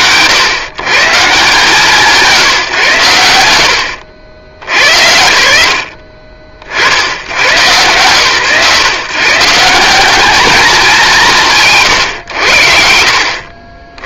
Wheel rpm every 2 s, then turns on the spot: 130, 120, 100, 70, 150, 170, 70.
none